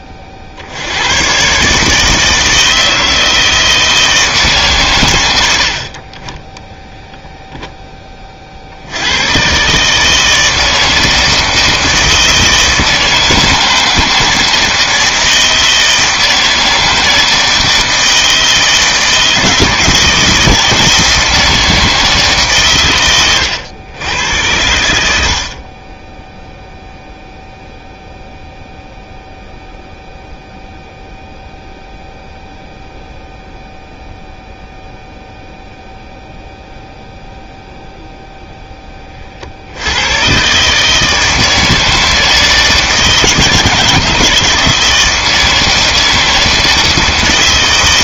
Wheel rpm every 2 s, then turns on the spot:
50, 160, 130, 10, 60, 160, 160, 160, 160, 160, 160, 130, 100, 0, 0, 0, 0, 0, 0, 10, 140, 160, 160, 160.
none